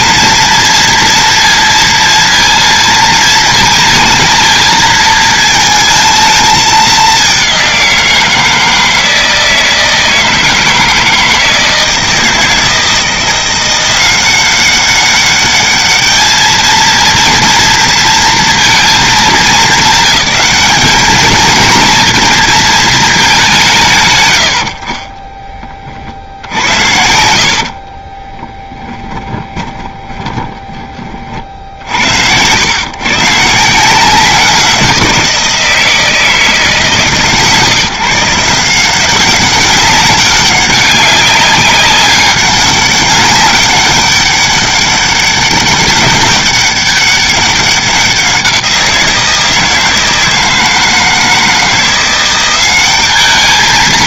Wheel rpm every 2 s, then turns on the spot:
230, 230, 220, 210, 160, 160, 160, 190, 220, 230, 220, 220, 60, 60, 10, 20, 110, 180, 150, 170, 200, 200, 200, 200, 180, 160, 190.
26-30